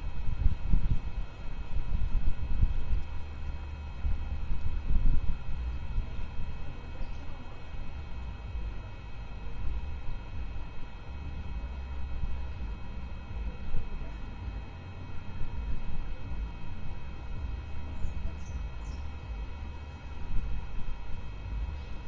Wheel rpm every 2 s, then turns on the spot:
0, 0, 0, 0, 0, 0, 0, 0, 0, 0, 0.
none